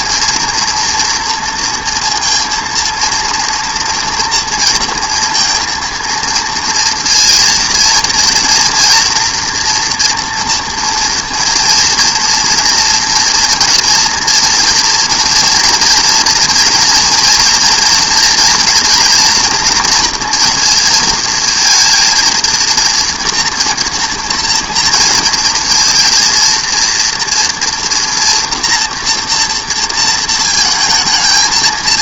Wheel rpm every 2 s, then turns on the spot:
230, 230, 230, 230, 230, 230, 230, 230, 230, 230, 230, 230, 230, 230, 240, 230.
none